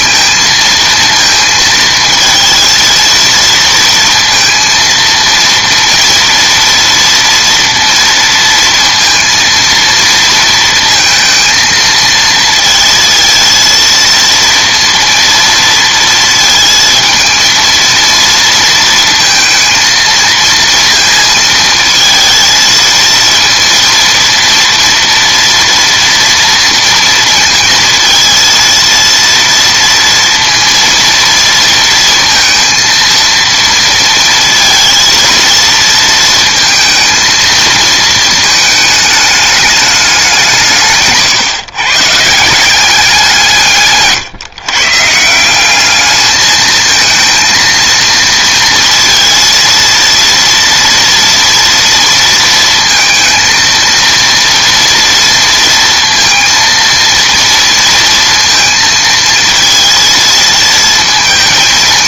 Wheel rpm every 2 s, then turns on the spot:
230, 230, 230, 240, 230, 230, 220, 230, 230, 230, 230, 230, 240, 230, 230, 230, 230, 230, 230, 220, 160, 190, 140, 220, 230, 230, 230, 230, 230, 230, 230.
none